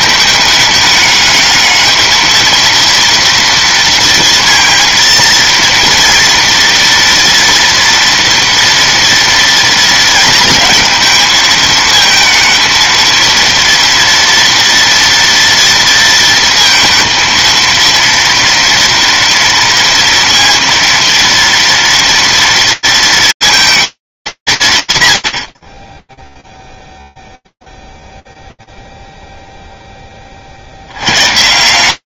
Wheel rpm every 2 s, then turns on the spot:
210, 230, 230, 230, 240, 220, 220, 230, 230, 230, 230, 230, 210, 20, 0, 20.
none